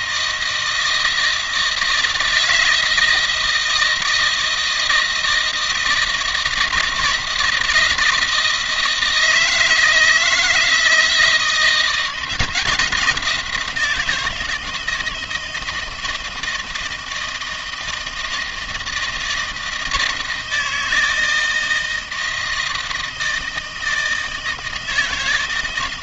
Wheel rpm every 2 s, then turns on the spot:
160, 160, 160, 160, 160, 160, 170, 160, 160, 160, 160, 160, 160.
none